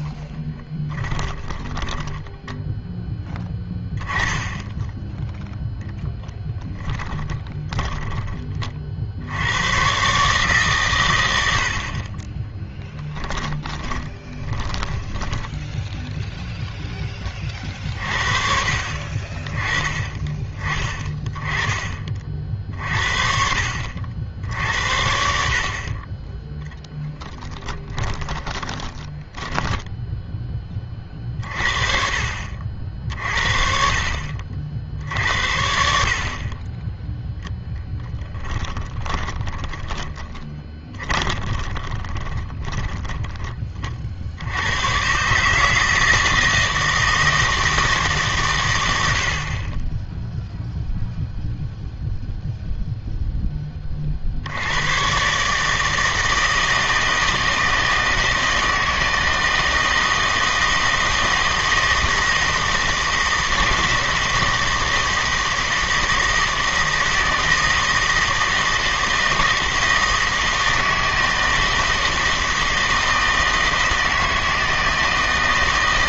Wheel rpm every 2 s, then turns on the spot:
10, 10, 10, 10, 40, 130, 20, 10, 10, 50, 20, 50, 70, 0, 20, 20, 50, 60, 20, 20, 20, 10, 100, 160, 110, 0, 0, 100, 160, 160, 160, 160, 160, 160, 160, 160, 160, 160.
0-2 6-8 12-16 28-30 38-44